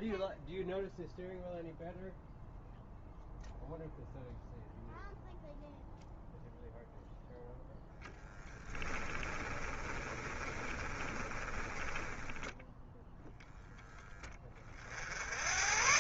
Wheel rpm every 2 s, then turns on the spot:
0, 0, 0, 0, 10, 20, 0, 50.
8-12